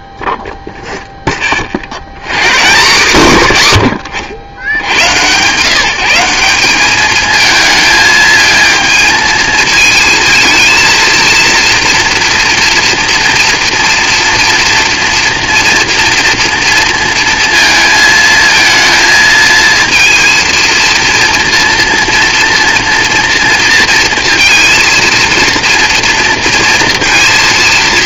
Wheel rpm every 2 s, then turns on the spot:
10, 120, 80, 190, 220, 230, 230, 230, 230, 230, 230, 230, 230, 230.
none